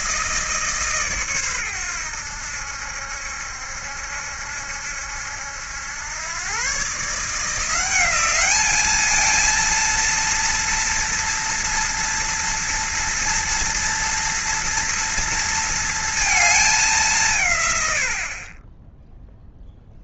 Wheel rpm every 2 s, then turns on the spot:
160, 80, 70, 120, 200, 230, 230, 230, 220, 40.
none